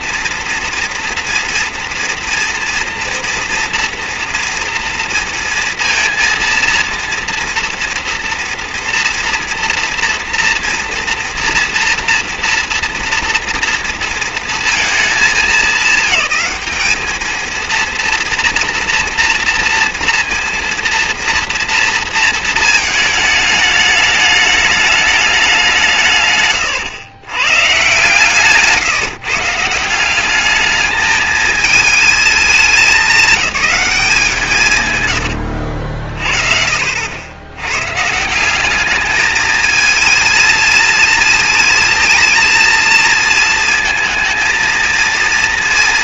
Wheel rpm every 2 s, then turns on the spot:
230, 230, 230, 230, 230, 230, 230, 230, 210, 230, 230, 220, 210, 110, 150, 210, 210, 150, 50, 200, 220, 220, 220.
34-38